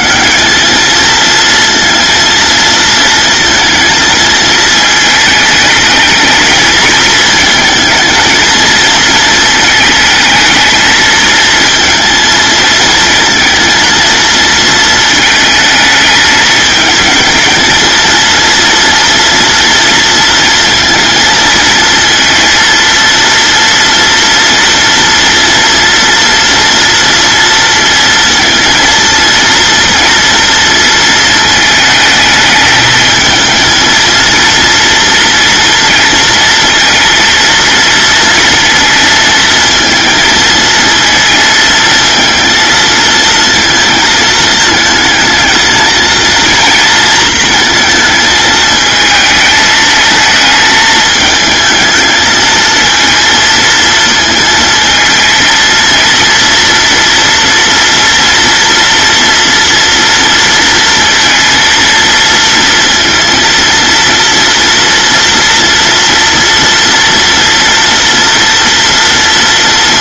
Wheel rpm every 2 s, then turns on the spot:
220, 230, 220, 220, 230, 220, 230, 220, 220, 230, 230, 230, 230, 230, 230, 230, 220, 230, 230, 220, 220, 230, 220, 230, 220, 220, 230, 230, 230, 230, 230, 230, 230, 230, 230.
none